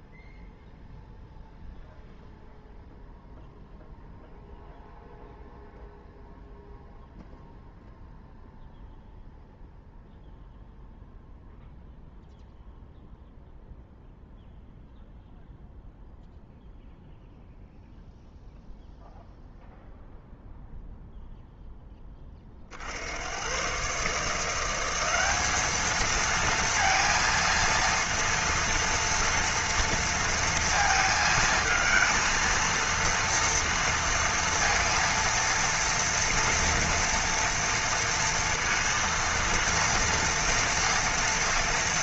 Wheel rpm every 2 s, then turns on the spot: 0, 0, 0, 0, 0, 0, 0, 0, 0, 0, 0, 70, 180, 230, 230, 230, 230, 230, 230, 230, 230.
none